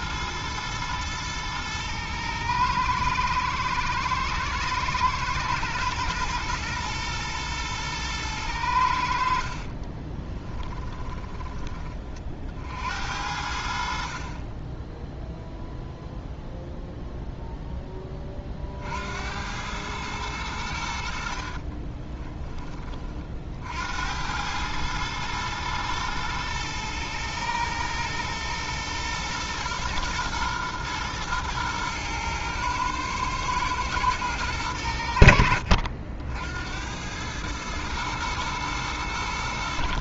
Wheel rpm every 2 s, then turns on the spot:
110, 110, 110, 120, 90, 20, 70, 20, 0, 50, 80, 20, 110, 110, 120, 110, 110, 90, 90, 100.
10-12